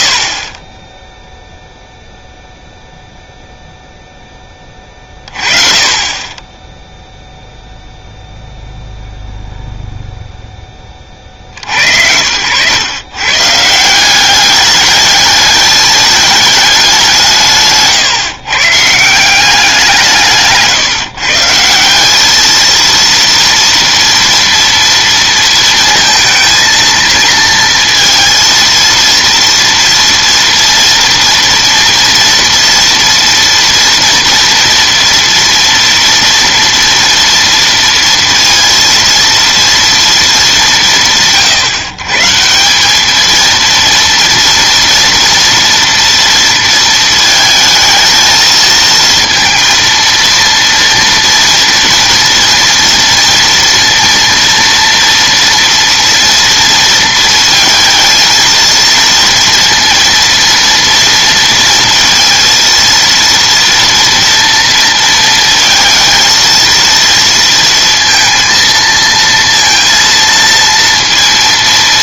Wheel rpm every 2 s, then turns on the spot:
30, 0, 20, 10, 0, 10, 100, 200, 210, 150, 160, 230, 230, 230, 230, 230, 230, 230, 230, 230, 190, 170, 230, 230, 220, 230, 230, 230, 230, 230, 230, 230, 230, 230, 230, 230.
20-22